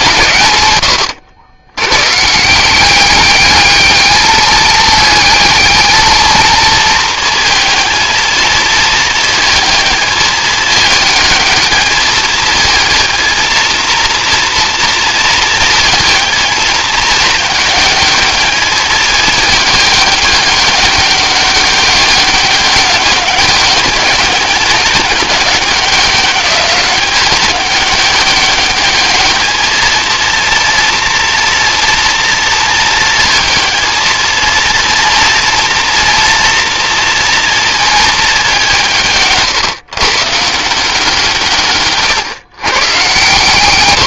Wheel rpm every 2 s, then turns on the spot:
100, 180, 220, 220, 220, 220, 220, 230, 210, 210, 200, 200, 200, 200, 210, 230, 230, 230, 230, 170, 170, 120.
none